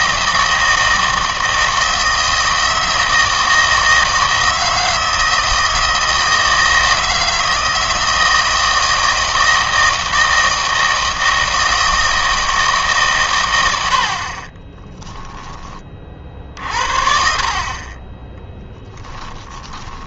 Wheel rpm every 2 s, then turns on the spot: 160, 160, 160, 160, 160, 160, 150, 30, 50, 10.
14-20